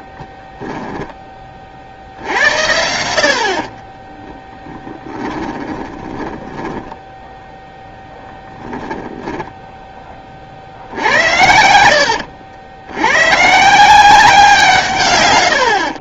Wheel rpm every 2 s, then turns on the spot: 10, 90, 10, 10, 0, 40, 90, 160.
0-2 4-8